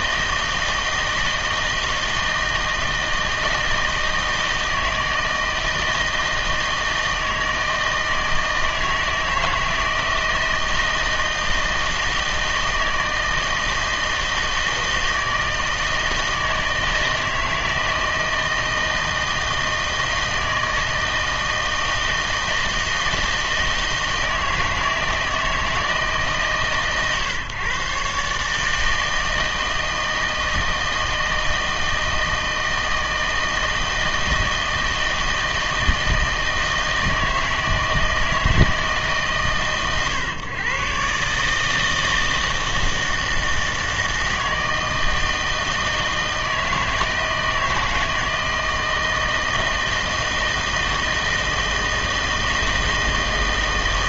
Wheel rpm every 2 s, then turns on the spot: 160, 160, 160, 160, 160, 160, 160, 160, 160, 160, 160, 160, 160, 140, 150, 160, 160, 160, 160, 160, 130, 160, 160, 160, 160, 160, 160.
none